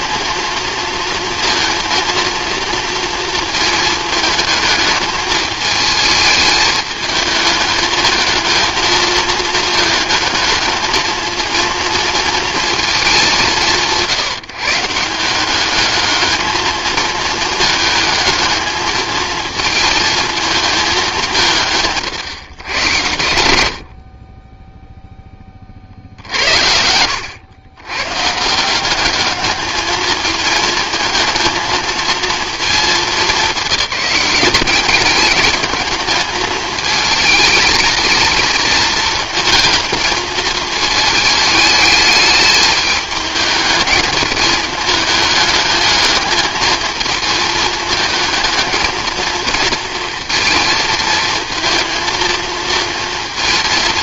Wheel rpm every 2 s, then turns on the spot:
230, 230, 220, 220, 220, 220, 220, 150, 220, 220, 210, 120, 10, 80, 170, 220, 220, 200, 220, 220, 220, 210, 220, 220, 220, 220, 230.
none